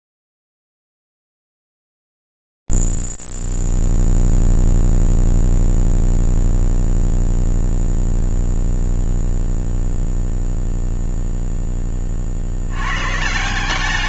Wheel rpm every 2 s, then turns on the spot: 0, 0, 0, 0, 0, 0, 40.
none